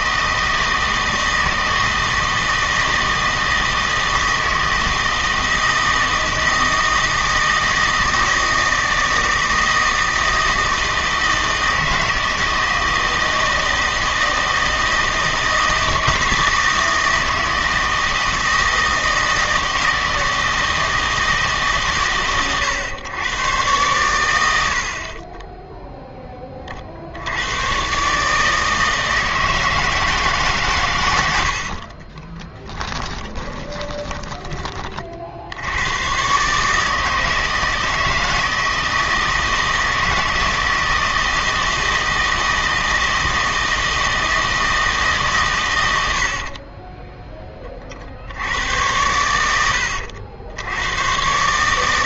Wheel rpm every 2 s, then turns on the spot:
160, 160, 160, 160, 160, 160, 160, 160, 160, 160, 160, 120, 70, 40, 160, 140, 20, 30, 150, 160, 160, 160, 160, 40, 90, 90.
32-34 46-48